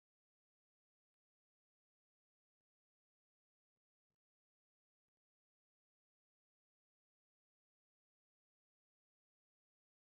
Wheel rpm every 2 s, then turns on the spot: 0, 0, 0, 0, 0.
none